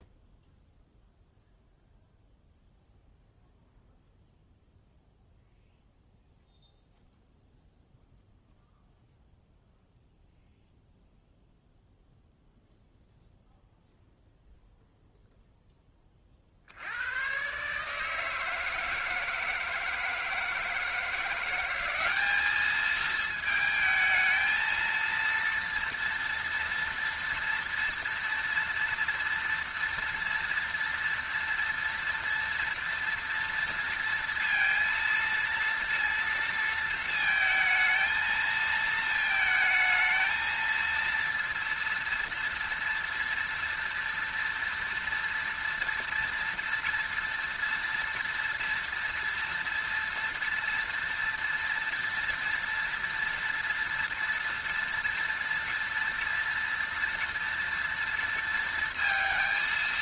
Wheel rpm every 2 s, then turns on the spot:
0, 0, 0, 0, 0, 0, 0, 0, 60, 160, 160, 210, 220, 230, 240, 230, 230, 230, 230, 230, 230, 230, 230, 230, 230, 230, 230, 230, 230, 230.
none